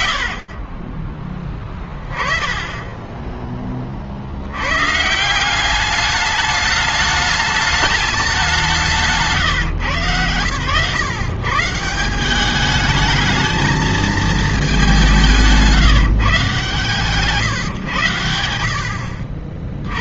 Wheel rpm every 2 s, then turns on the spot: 10, 80, 210, 200, 120, 190, 220, 150, 100, 150.
none